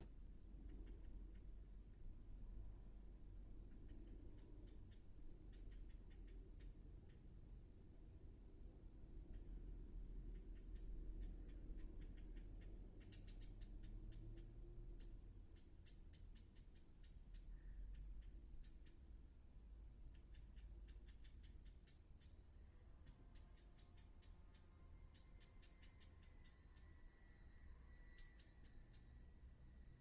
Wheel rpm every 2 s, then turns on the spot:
0, 0, 0, 0, 0, 0, 0, 0, 0, 0, 0, 0, 0, 0, 0.
none